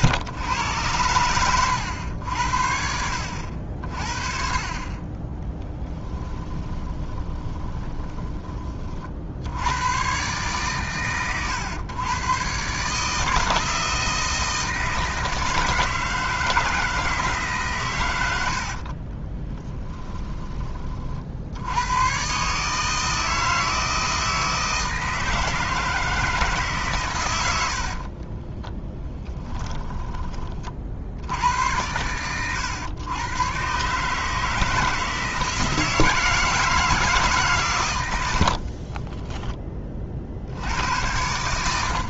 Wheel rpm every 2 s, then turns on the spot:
100, 60, 30, 20, 40, 130, 140, 160, 160, 60, 30, 150, 160, 150, 10, 40, 110, 160, 160, 40, 80.
6-8 18-20 28-30 38-40